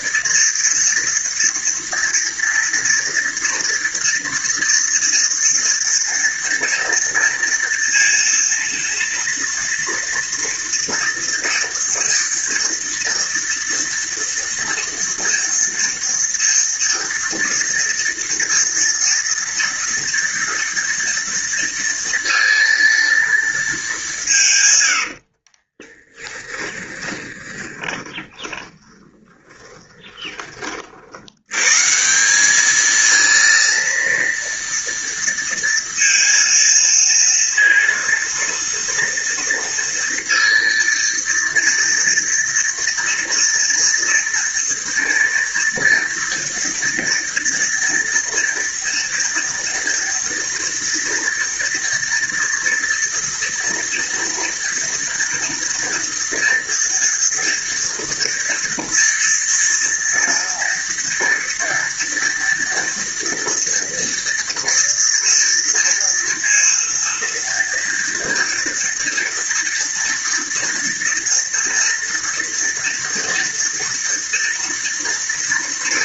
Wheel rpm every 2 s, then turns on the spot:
230, 230, 230, 230, 230, 230, 230, 230, 230, 230, 230, 230, 80, 20, 20, 60, 220, 230, 230, 230, 230, 230, 230, 230, 230, 230, 230, 230, 230, 230, 230, 230, 230, 230, 230, 230, 230, 230.
24-30